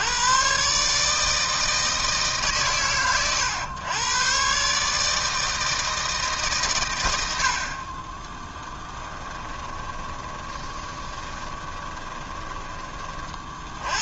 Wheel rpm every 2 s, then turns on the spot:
140, 120, 150, 110, 20, 20, 30.
8-12